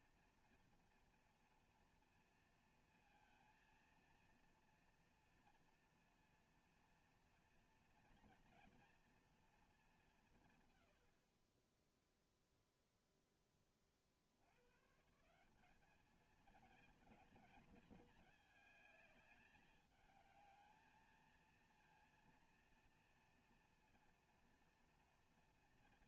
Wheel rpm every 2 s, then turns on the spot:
230, 230, 230, 240, 230, 180, 0, 80, 220, 210, 220, 230, 230.
none